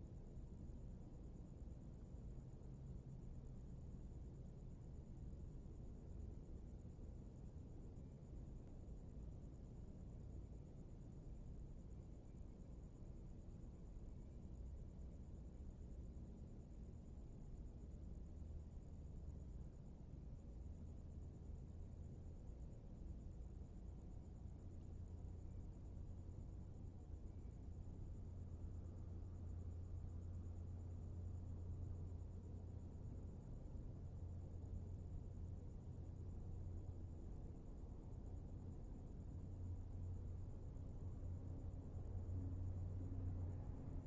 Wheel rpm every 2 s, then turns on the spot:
0, 0, 0, 0, 0, 0, 0, 0, 0, 0, 0, 0, 0, 0, 0, 0, 0, 0, 0, 0, 0, 0.
none